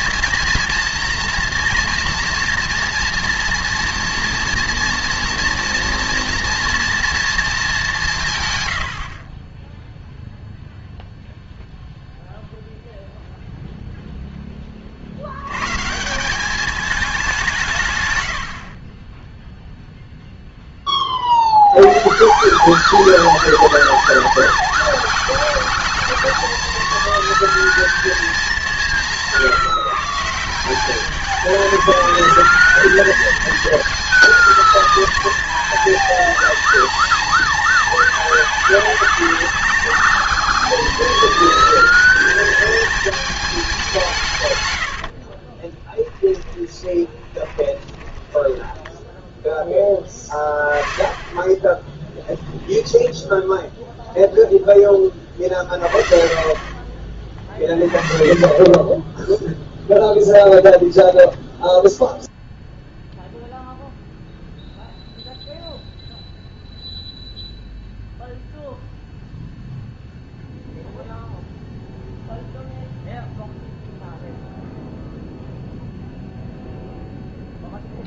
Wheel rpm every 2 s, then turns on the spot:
230, 230, 230, 230, 110, 0, 0, 30, 210, 40, 20, 210, 220, 230, 190, 200, 220, 230, 230, 220, 230, 220, 100, 20, 10, 20, 10, 10, 40, 20, 10, 0, 0, 0, 0, 0, 0, 0, 0.
18-20 46-52 60-62